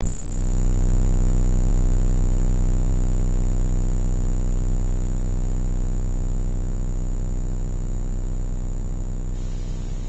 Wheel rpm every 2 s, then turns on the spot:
0, 0, 0, 0, 0.
none